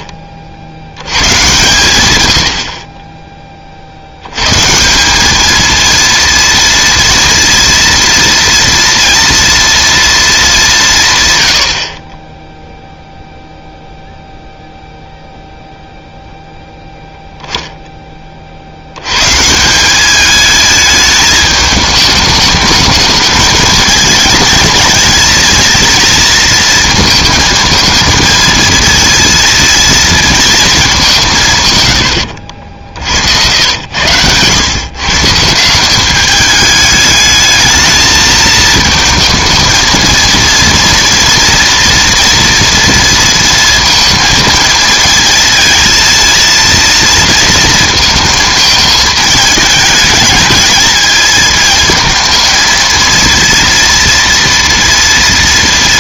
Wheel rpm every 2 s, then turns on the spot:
70, 70, 140, 230, 230, 200, 0, 0, 0, 60, 210, 210, 230, 230, 220, 220, 70, 120, 210, 220, 230, 230, 220, 230, 220, 220, 230, 230.
32-34